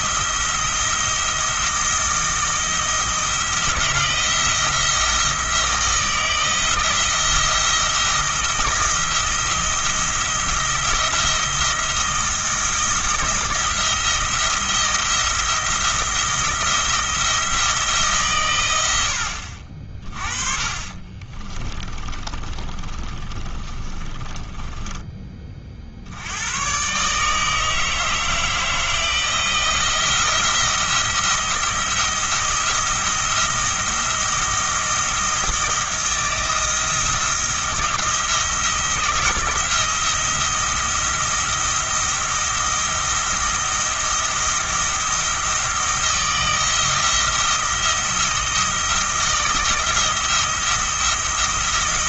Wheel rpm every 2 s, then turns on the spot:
170, 160, 160, 170, 170, 170, 170, 170, 170, 110, 40, 30, 20, 110, 160, 170, 170, 170, 160, 170, 170, 170, 170, 170, 170, 170.
20-24